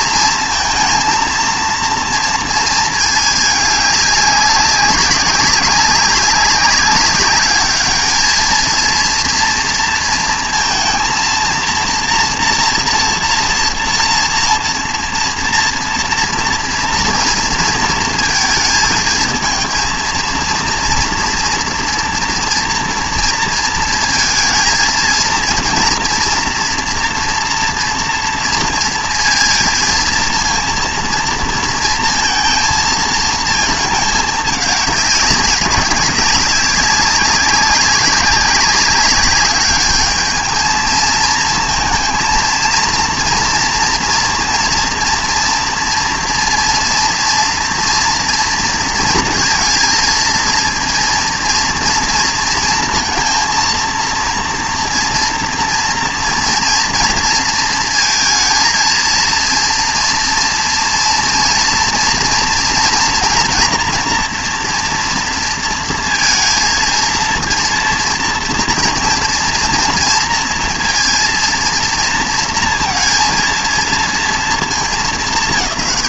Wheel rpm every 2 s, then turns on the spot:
230, 230, 200, 190, 220, 230, 230, 230, 230, 220, 230, 240, 220, 230, 230, 230, 230, 200, 190, 190, 220, 230, 230, 230, 230, 230, 230, 230, 230, 230, 230, 230, 230, 230, 240, 230, 230, 220.
none